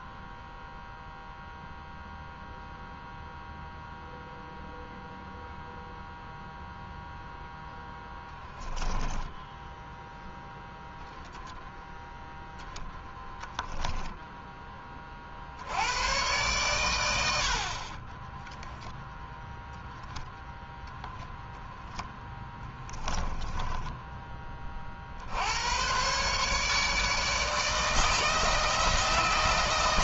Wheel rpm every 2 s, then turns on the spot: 0, 0, 0, 0, 10, 10, 0, 30, 90, 0, 10, 10, 50, 150, 160.
8-10 22-24